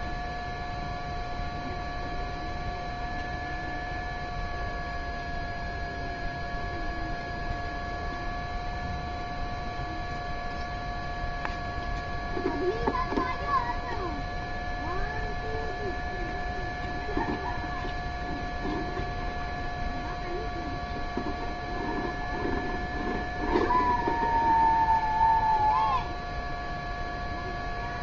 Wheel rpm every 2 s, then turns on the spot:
0, 0, 0, 0, 0, 0, 0, 0, 0, 0, 0, 0, 0, 0.
none